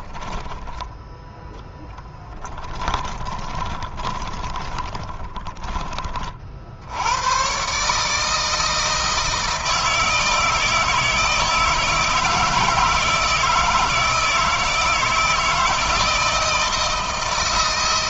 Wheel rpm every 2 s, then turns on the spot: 10, 10, 20, 60, 160, 160, 160, 160, 160.
2-6